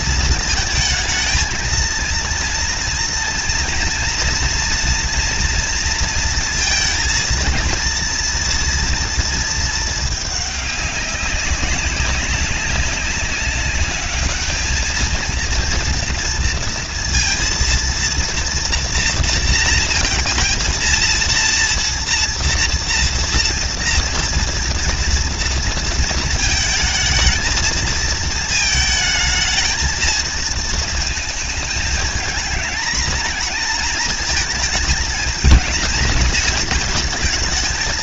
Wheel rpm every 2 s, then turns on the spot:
230, 230, 230, 230, 230, 210, 190, 210, 230, 230, 230, 230, 230, 230, 230, 230, 220, 220, 220.
none